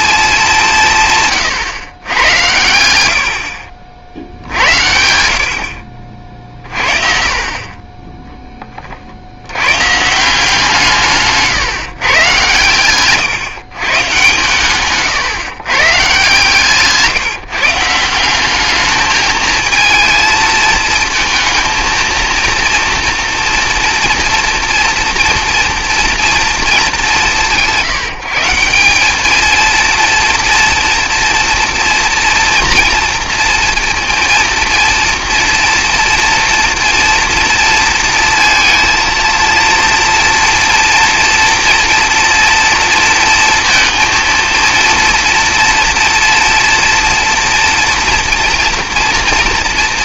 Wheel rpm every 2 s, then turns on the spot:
170, 90, 70, 40, 30, 170, 110, 130, 150, 210, 220, 230, 230, 210, 180, 230, 230, 230, 230, 230, 230, 230, 230, 230, 230.
16-18